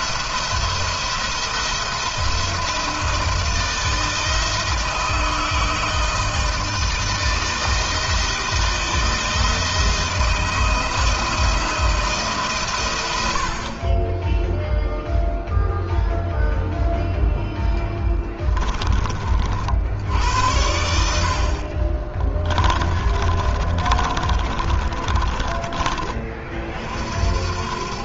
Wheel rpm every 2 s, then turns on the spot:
170, 170, 160, 160, 160, 170, 130, 0, 0, 20, 90, 30, 30, 50.
22-26